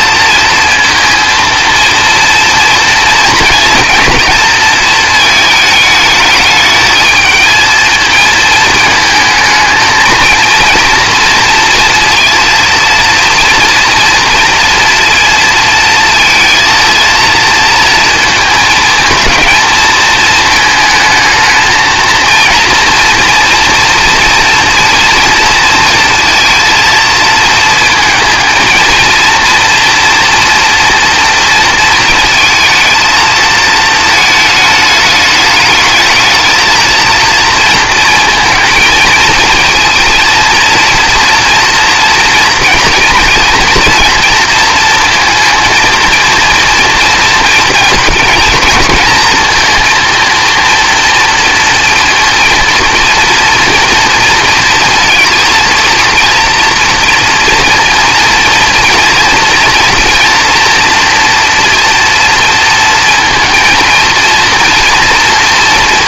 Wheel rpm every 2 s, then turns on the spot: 230, 230, 230, 220, 220, 230, 230, 230, 230, 220, 220, 230, 240, 230, 220, 230, 230, 220, 220, 220, 230, 230, 230, 230, 230, 230, 230, 230, 240, 230, 230, 230, 230.
none